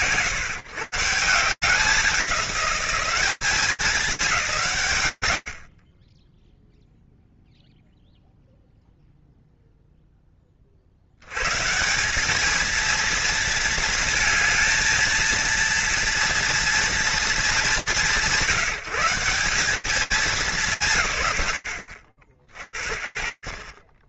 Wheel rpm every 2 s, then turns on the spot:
170, 200, 80, 0, 0, 40, 210, 230, 230, 170, 190, 40.
none